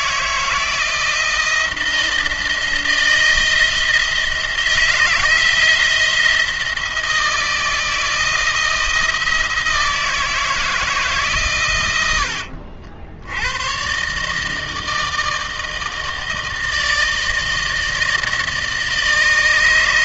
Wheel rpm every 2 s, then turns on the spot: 160, 160, 160, 160, 160, 160, 80, 150, 160, 160.
none